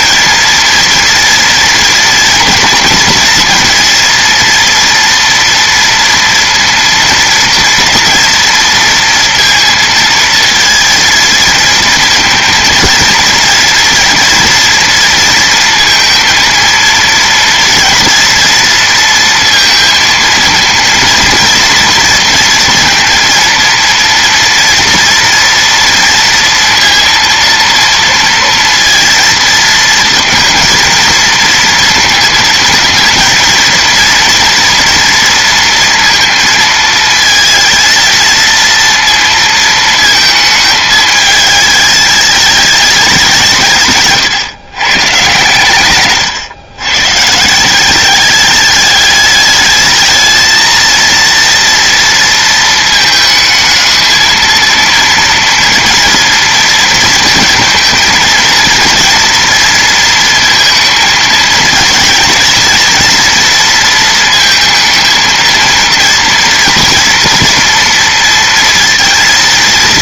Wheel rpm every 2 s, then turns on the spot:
240, 230, 230, 230, 230, 230, 230, 230, 230, 230, 230, 230, 240, 230, 230, 230, 220, 230, 220, 230, 220, 200, 130, 130, 210, 230, 220, 230, 230, 230, 220, 230, 220, 230, 230.
none